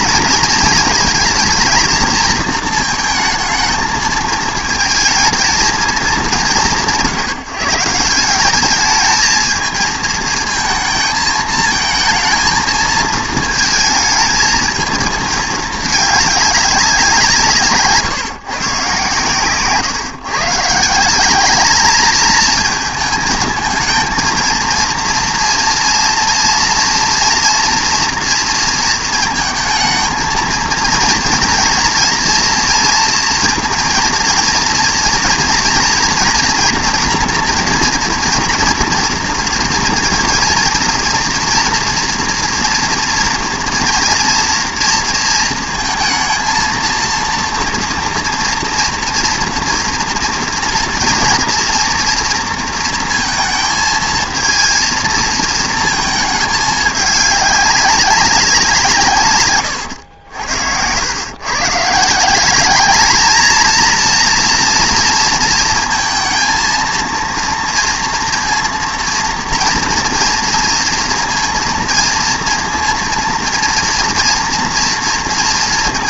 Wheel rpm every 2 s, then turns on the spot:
230, 220, 220, 160, 210, 220, 230, 220, 200, 130, 140, 220, 230, 230, 230, 230, 230, 230, 240, 230, 230, 230, 230, 220, 240, 230, 230, 230, 210, 170, 90, 200, 230, 230, 230, 230, 230, 230.
none